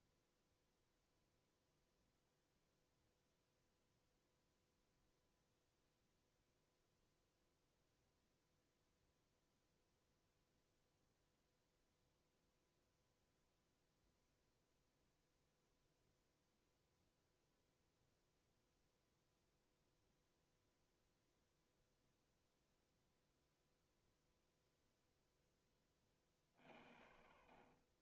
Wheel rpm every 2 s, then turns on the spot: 0, 0, 0, 0, 0, 0, 0, 0, 0, 0, 0, 0, 0, 60.
none